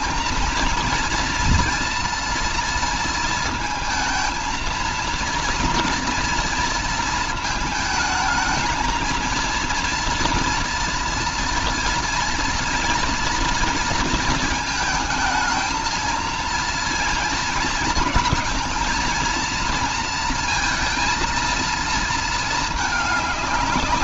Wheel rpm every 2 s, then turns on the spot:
230, 230, 220, 230, 220, 230, 230, 220, 230, 230, 230, 210.
none